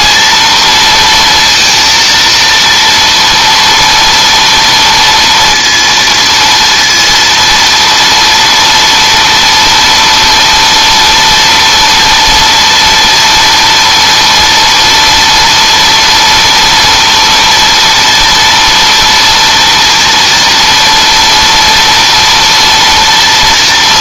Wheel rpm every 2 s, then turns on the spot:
230, 230, 230, 230, 230, 230, 230, 230, 230, 230, 230, 240.
none